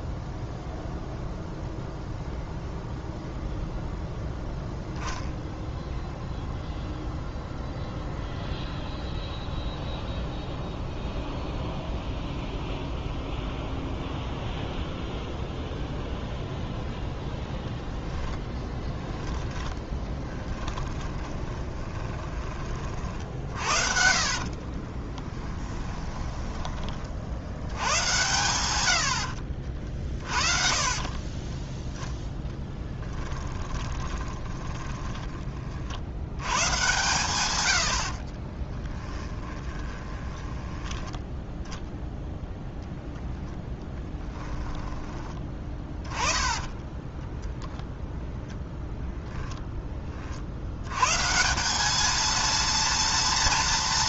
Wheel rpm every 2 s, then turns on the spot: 0, 0, 10, 0, 0, 0, 0, 0, 0, 10, 10, 30, 40, 20, 120, 40, 0, 20, 110, 30, 10, 0, 10, 20, 0, 70, 230.
18-22 24-28 30-32 34-36 38-42 44-48